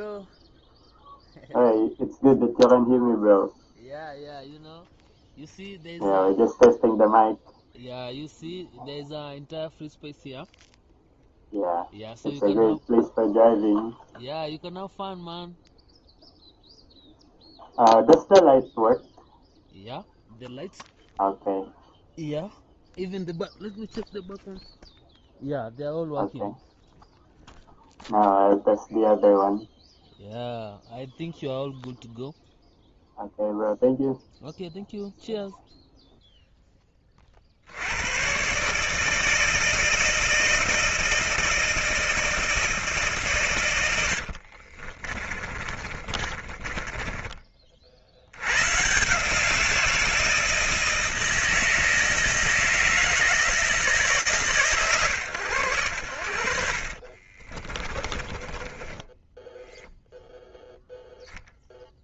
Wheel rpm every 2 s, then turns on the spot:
0, 0, 0, 0, 0, 0, 0, 0, 0, 0, 0, 0, 0, 0, 0, 0, 0, 0, 20, 150, 160, 160, 40, 20, 130, 160, 160, 120, 50, 10, 0.
44-48 56-60